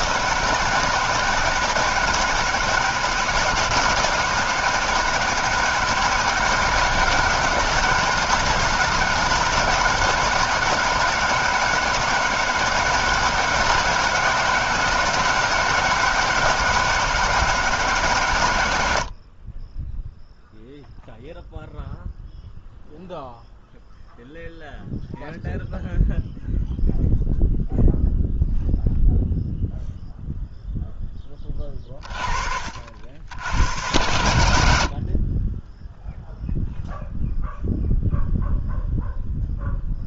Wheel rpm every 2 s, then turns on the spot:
150, 160, 160, 150, 160, 150, 160, 160, 170, 90, 0, 0, 0, 0, 0, 0, 50, 80, 0, 0.
none